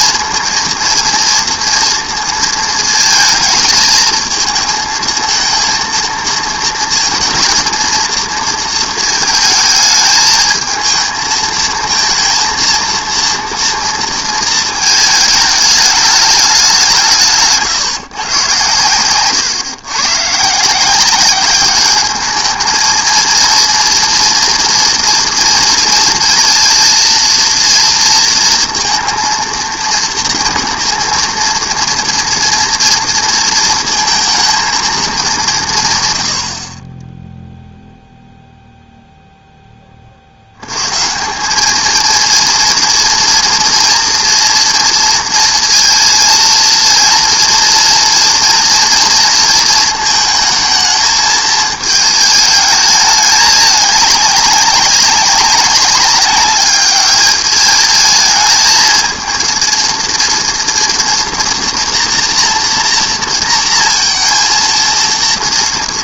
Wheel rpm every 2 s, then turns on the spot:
230, 230, 230, 230, 230, 220, 230, 220, 200, 120, 150, 220, 230, 230, 230, 230, 230, 220, 70, 0, 80, 230, 240, 230, 230, 220, 220, 200, 210, 230, 230, 240, 230.
none